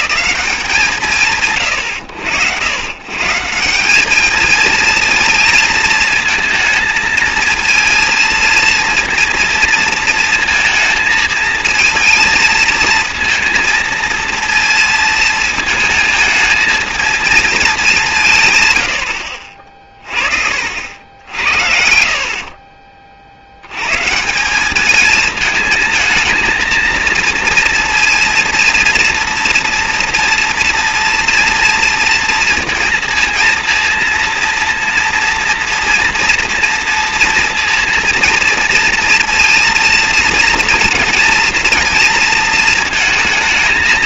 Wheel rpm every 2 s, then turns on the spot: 160, 90, 220, 220, 230, 230, 230, 230, 220, 120, 50, 40, 190, 230, 230, 230, 230, 230, 230, 230, 230, 230.
22-24